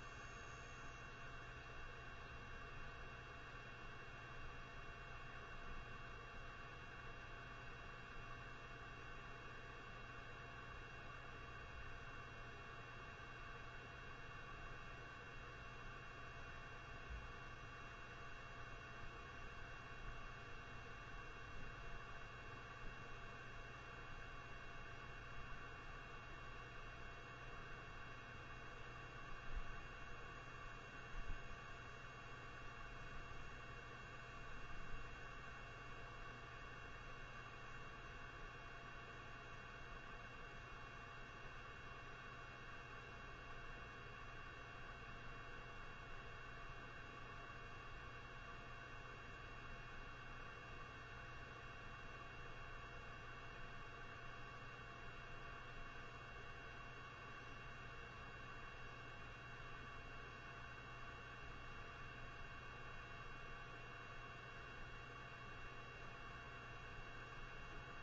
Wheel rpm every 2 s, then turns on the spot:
0, 0, 0, 0, 0, 0, 0, 0, 0, 0, 0, 0, 0, 0, 0, 0, 0, 0, 0, 0, 0, 0, 0, 0, 0, 0, 0, 0, 0, 0, 0, 0, 0, 0.
none